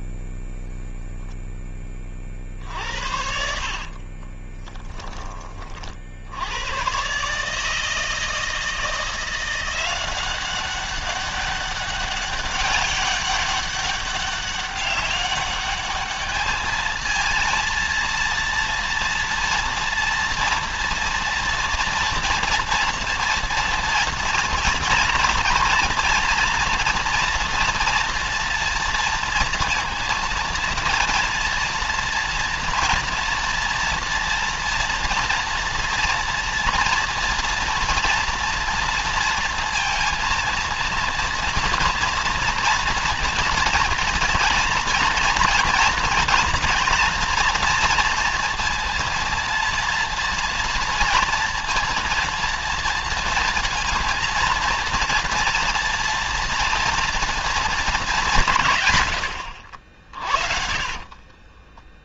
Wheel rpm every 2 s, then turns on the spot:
0, 70, 20, 110, 160, 190, 200, 200, 220, 230, 230, 230, 230, 230, 230, 230, 230, 230, 240, 230, 230, 230, 230, 230, 230, 230, 230, 230, 230, 150, 40.
2-6 60-62